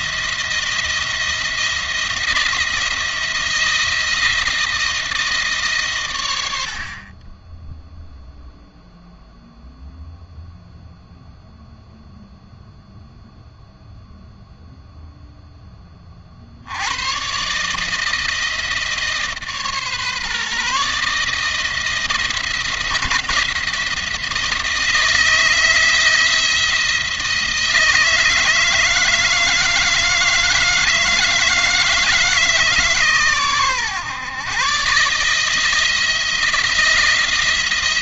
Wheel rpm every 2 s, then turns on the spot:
170, 170, 160, 60, 0, 0, 0, 0, 80, 160, 150, 170, 160, 170, 160, 160, 150, 130, 170.
none